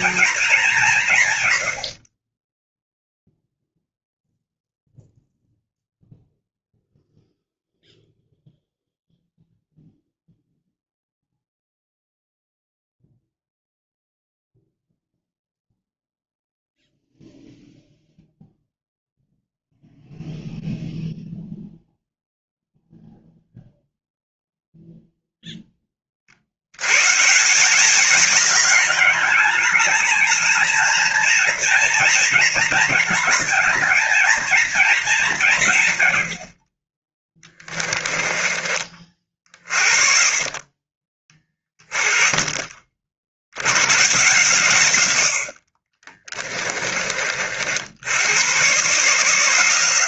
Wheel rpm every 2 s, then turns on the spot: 170, 0, 0, 0, 0, 0, 0, 0, 0, 0, 0, 0, 0, 110, 200, 220, 230, 210, 20, 40, 30, 50, 120, 30, 140.
none